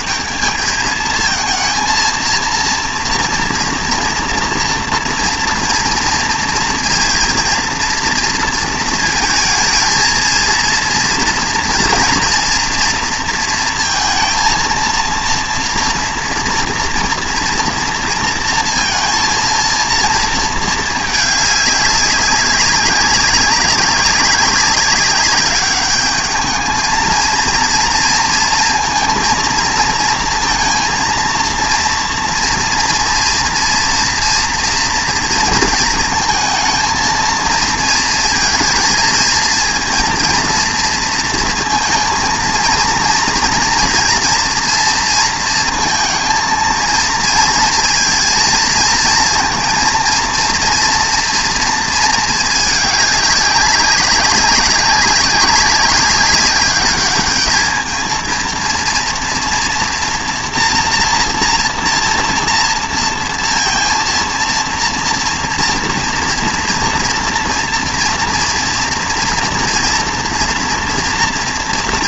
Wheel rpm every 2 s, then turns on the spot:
180, 230, 230, 230, 230, 230, 230, 230, 240, 230, 220, 190, 190, 220, 230, 220, 230, 230, 220, 230, 230, 230, 230, 230, 230, 230, 220, 200, 200, 220, 240, 230, 230, 230, 230, 240.
none